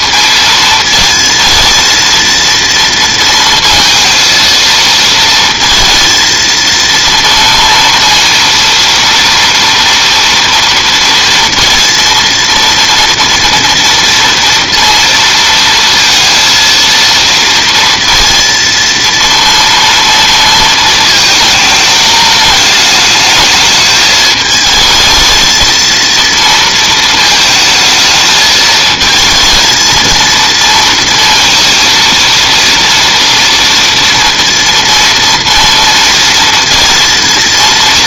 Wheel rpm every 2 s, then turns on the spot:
230, 230, 230, 230, 230, 230, 230, 230, 230, 230, 220, 210, 220, 230, 220, 230, 230, 230, 230.
none